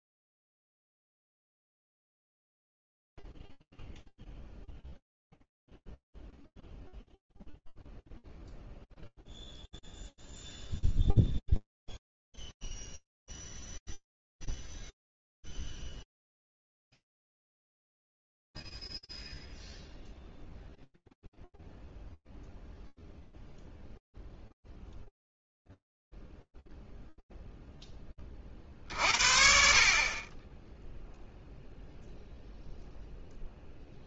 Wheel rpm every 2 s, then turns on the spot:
0, 0, 0, 0, 0, 0, 0, 0, 0, 0, 0, 0, 0, 0, 50, 0, 0.
none